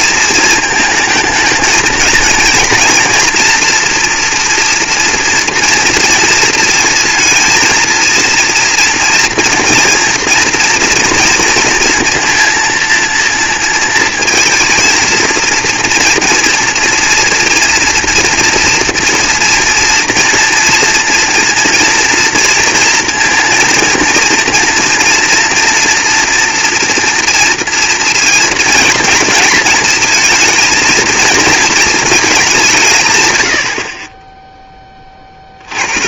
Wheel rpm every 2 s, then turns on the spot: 220, 230, 230, 230, 240, 230, 230, 230, 230, 230, 230, 230, 240, 230, 230, 220, 100, 30.
none